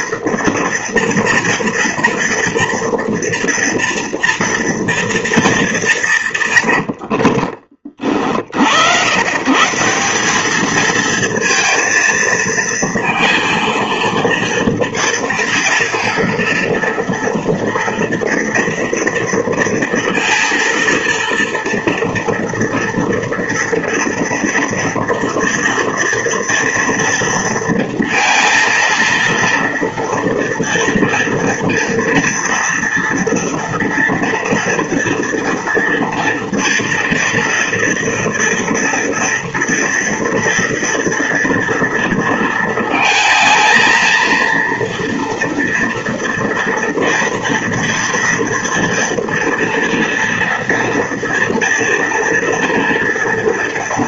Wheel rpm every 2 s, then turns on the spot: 230, 230, 230, 150, 60, 200, 230, 230, 230, 230, 230, 230, 230, 230, 230, 230, 230, 230, 230, 230, 230, 230, 230, 230, 230, 230, 230.
none